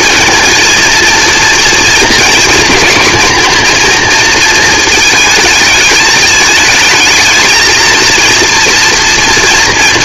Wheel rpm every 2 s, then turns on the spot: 220, 230, 220, 220, 230.
none